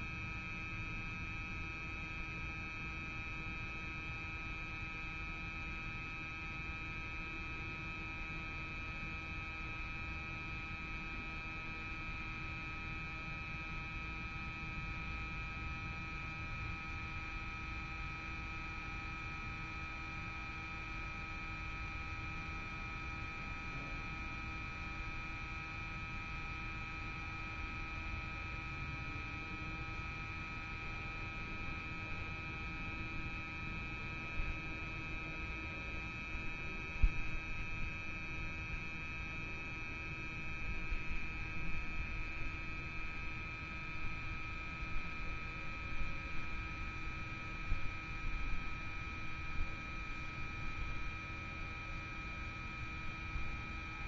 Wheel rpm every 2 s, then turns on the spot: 0, 0, 0, 0, 0, 0, 0, 0, 0, 0, 0, 0, 0, 0, 0, 0, 0, 0, 0, 0, 0, 0, 0, 0, 0, 0, 0.
none